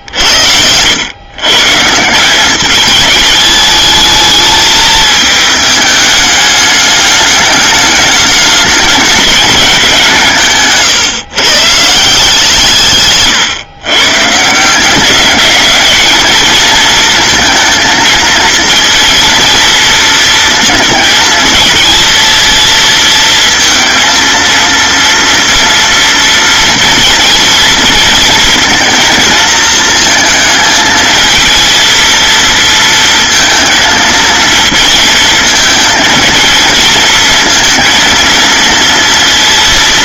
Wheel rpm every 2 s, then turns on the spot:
100, 210, 210, 210, 210, 140, 140, 190, 230, 230, 220, 230, 230, 230, 220, 220, 230, 220, 230, 230.
12-14